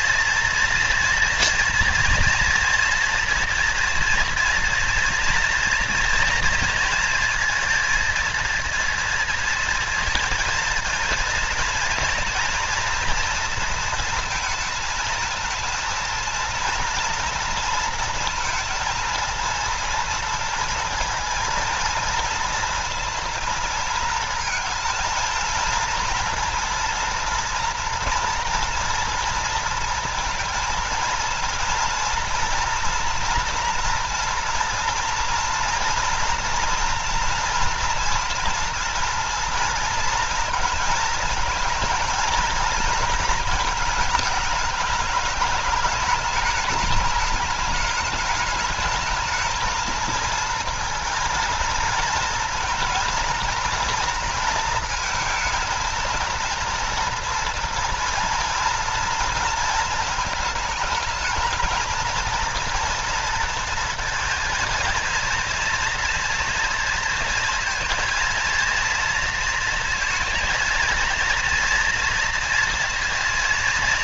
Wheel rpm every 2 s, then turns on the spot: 230, 230, 230, 230, 230, 230, 240, 230, 230, 230, 230, 230, 230, 230, 230, 230, 230, 230, 230, 230, 230, 220, 210, 220, 210, 230, 230, 230, 230, 230, 220, 230, 230, 230, 230, 230, 230.
none